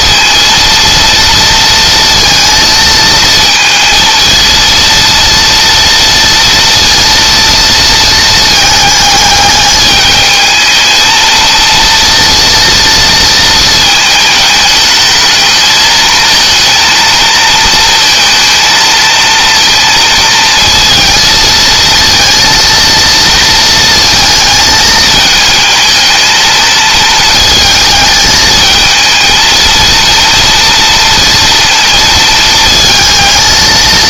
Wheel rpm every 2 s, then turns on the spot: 230, 220, 230, 230, 220, 220, 230, 210, 230, 230, 230, 230, 220, 220, 220, 230, 230.
none